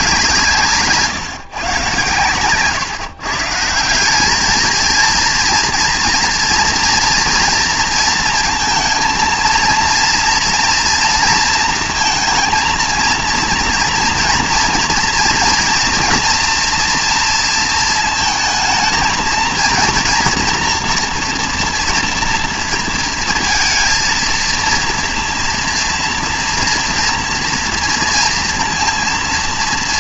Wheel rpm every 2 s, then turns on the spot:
150, 130, 220, 230, 230, 240, 230, 230, 230, 220, 240, 230, 230, 230, 230.
2-4